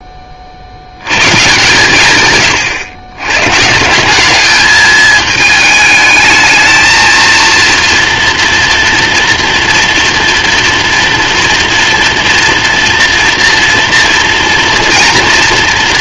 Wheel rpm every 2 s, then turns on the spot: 90, 110, 210, 220, 240, 230, 230, 230.
none